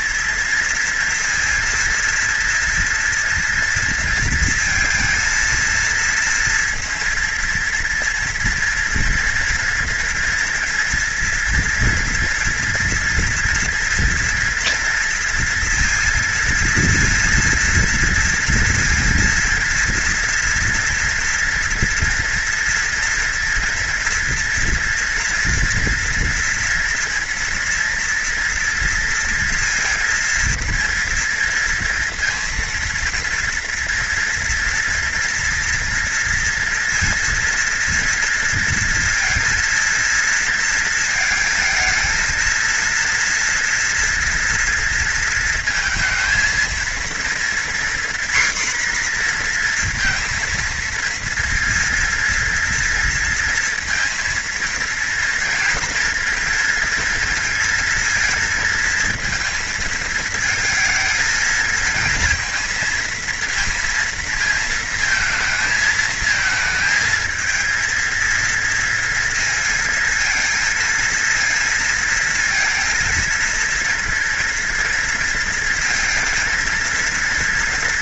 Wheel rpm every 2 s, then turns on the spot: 230, 230, 230, 230, 230, 230, 230, 240, 230, 230, 230, 230, 240, 240, 230, 230, 230, 230, 230, 230, 230, 230, 230, 230, 250, 230, 230, 230, 230, 230, 220, 230, 220, 220, 230, 230, 230, 230, 230.
none